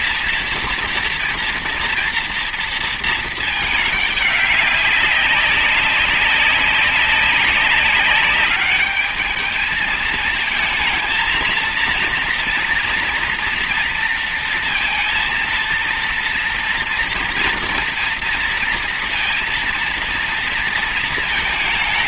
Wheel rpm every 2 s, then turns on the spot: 230, 220, 200, 200, 210, 230, 230, 230, 230, 230, 230.
none